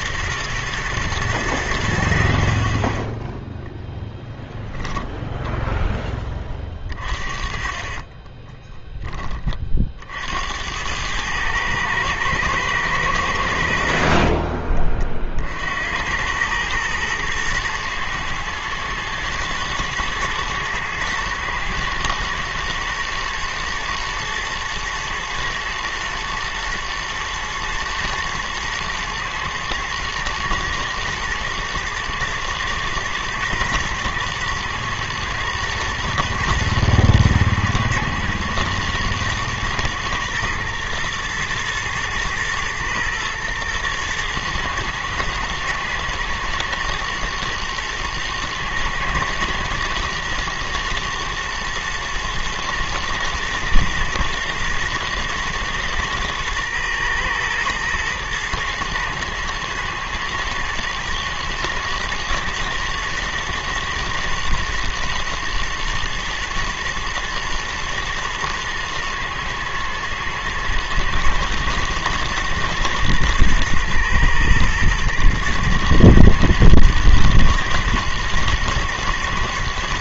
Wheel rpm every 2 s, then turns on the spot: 90, 0, 10, 40, 40, 110, 70, 60, 110, 110, 120, 120, 110, 110, 110, 120, 110, 110, 110, 110, 110, 110, 110, 120, 110, 110, 110, 110, 110, 110, 110, 110, 120, 110, 110, 120, 110, 110, 120, 110.
4-6